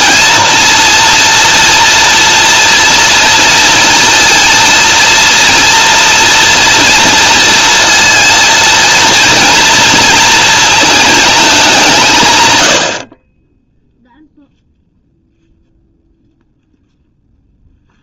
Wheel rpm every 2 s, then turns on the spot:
230, 230, 230, 230, 220, 220, 90, 0, 0.
none